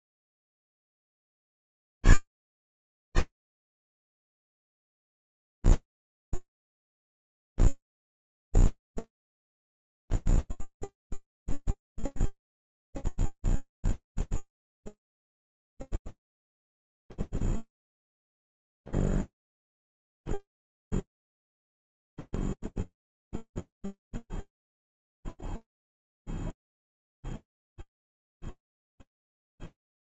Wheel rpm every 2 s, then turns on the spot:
10, 110, 0, 0, 0, 0, 0, 0, 0, 0, 0, 0, 0, 0, 0.
none